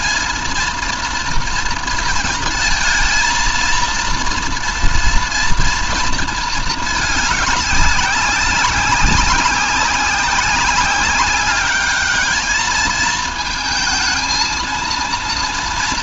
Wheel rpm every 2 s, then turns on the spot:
230, 220, 230, 220, 190, 200, 220, 230.
none